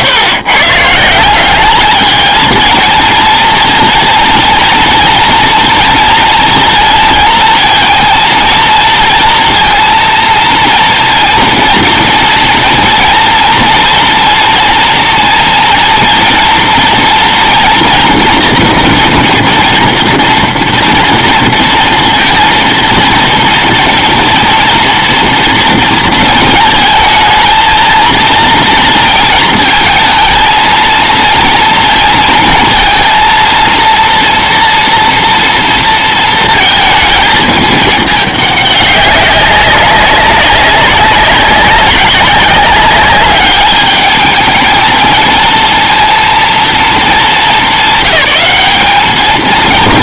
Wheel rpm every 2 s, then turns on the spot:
130, 220, 230, 230, 230, 230, 230, 230, 230, 240, 230, 230, 230, 220, 230, 220, 230, 230, 230, 210, 190, 190, 220, 220, 200.
none